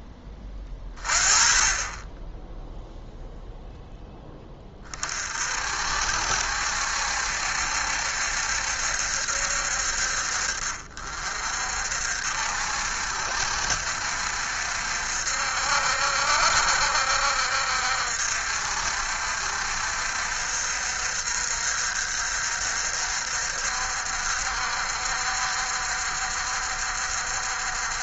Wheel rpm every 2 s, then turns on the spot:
30, 0, 50, 60, 70, 50, 60, 60, 60, 60, 60, 60, 60, 60.
none